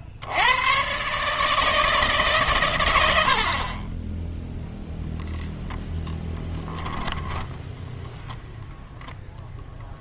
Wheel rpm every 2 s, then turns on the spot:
60, 160, 20, 10, 10.
6-8